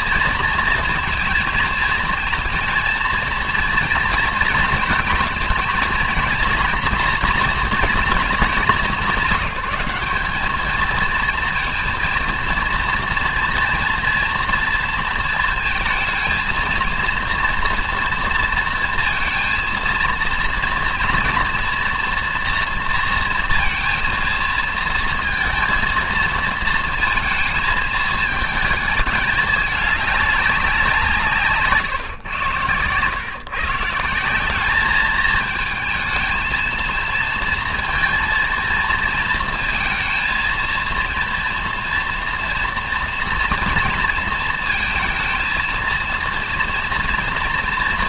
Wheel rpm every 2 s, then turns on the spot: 230, 230, 230, 230, 200, 220, 230, 230, 230, 230, 230, 240, 230, 230, 220, 190, 110, 200, 230, 230, 230, 240, 230, 230.
none